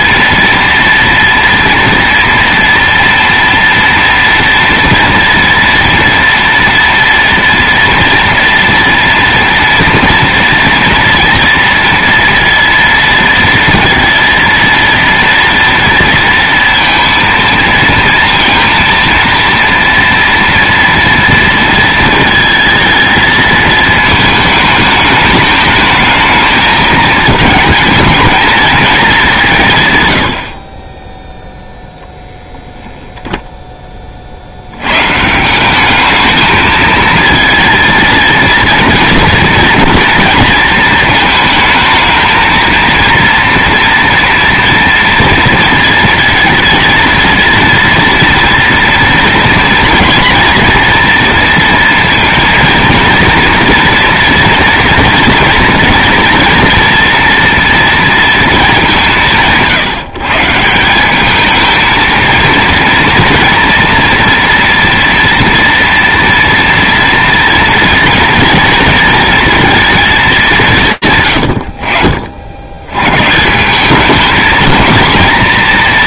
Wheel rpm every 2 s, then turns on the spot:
230, 230, 230, 230, 230, 230, 230, 230, 230, 230, 230, 220, 220, 220, 220, 30, 0, 100, 220, 230, 230, 230, 230, 230, 230, 240, 230, 230, 240, 200, 170, 230, 230, 230, 230, 190, 70, 220.
none